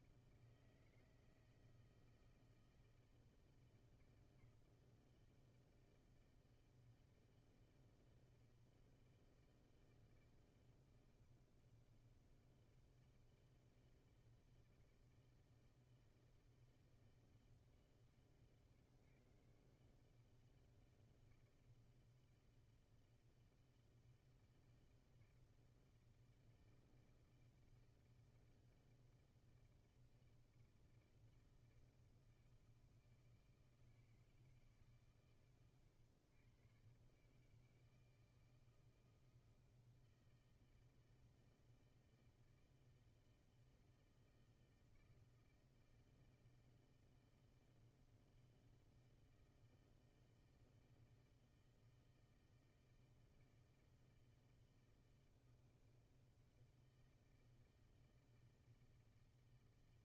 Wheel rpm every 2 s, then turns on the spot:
160, 160, 160, 160, 160, 160, 160, 160, 160, 130, 160, 160, 160, 160, 160, 160, 160, 160, 130, 160, 160, 160, 160, 160, 160, 160, 160, 160, 160, 160.
none